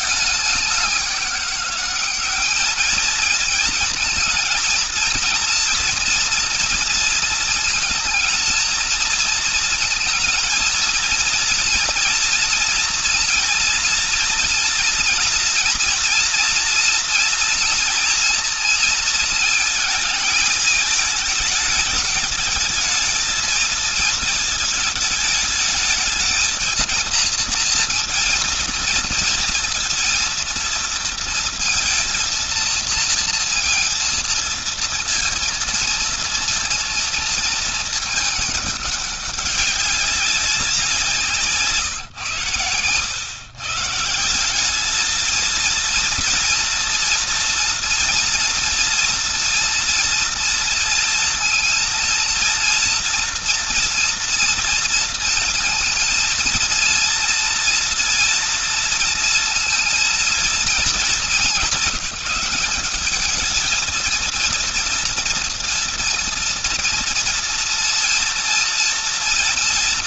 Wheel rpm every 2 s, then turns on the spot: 190, 220, 230, 230, 230, 230, 230, 230, 240, 230, 220, 220, 220, 230, 230, 230, 230, 230, 230, 200, 160, 120, 220, 230, 230, 230, 230, 230, 230, 230, 210, 200, 230, 230, 230.
none